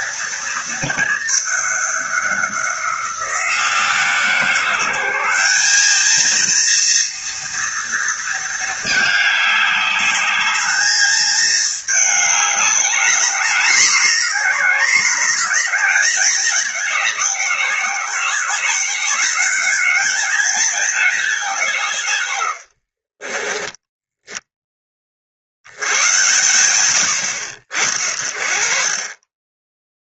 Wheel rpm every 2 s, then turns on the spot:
230, 190, 170, 230, 220, 210, 210, 210, 200, 180, 210, 80, 10, 110, 40.
22-24